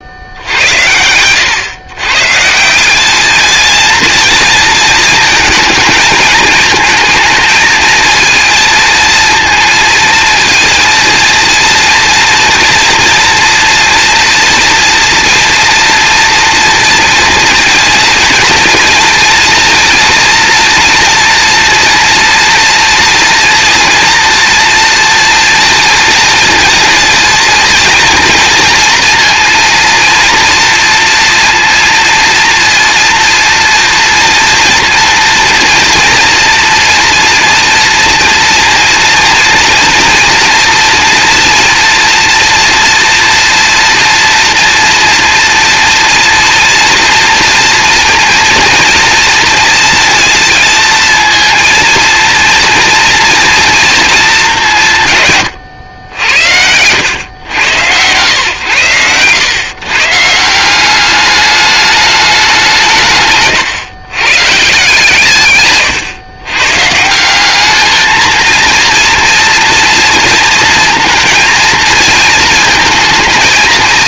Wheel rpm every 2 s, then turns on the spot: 100, 180, 230, 220, 230, 230, 230, 230, 230, 230, 230, 230, 230, 230, 230, 230, 230, 230, 240, 230, 240, 230, 230, 230, 230, 230, 230, 170, 90, 120, 190, 170, 140, 150, 230, 230, 220.
none